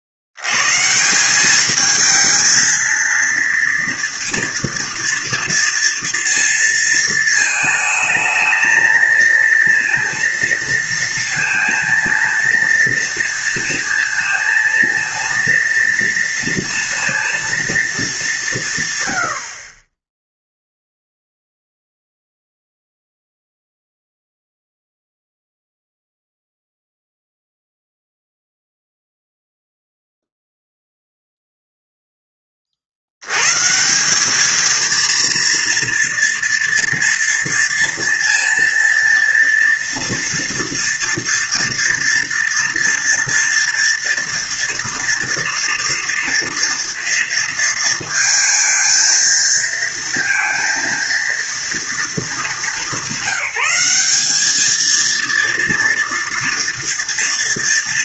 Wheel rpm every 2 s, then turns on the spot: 60, 220, 230, 230, 220, 230, 230, 230, 230, 180, 0, 0, 0, 0, 0, 0, 20, 210, 230, 230, 230, 230, 230, 230, 220, 230, 210, 210, 230.
none